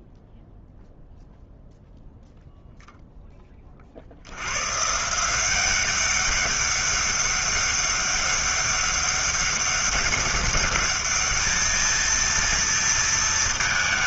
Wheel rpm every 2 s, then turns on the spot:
0, 0, 130, 200, 200, 210, 230.
none